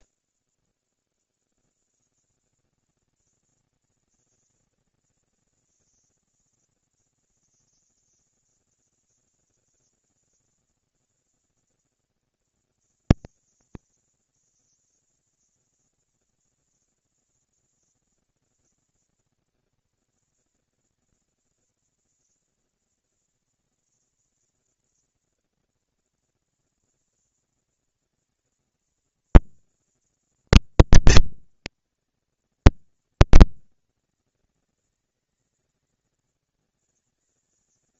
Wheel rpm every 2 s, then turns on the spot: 0, 110, 220, 240, 230, 230, 230, 230, 230, 230, 230, 240, 230, 230, 230, 230, 220, 200, 200.
none